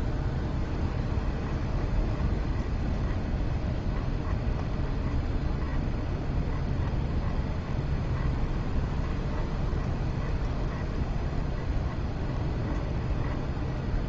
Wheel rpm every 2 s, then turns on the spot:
10, 20, 20, 20, 20, 20, 20.
0-14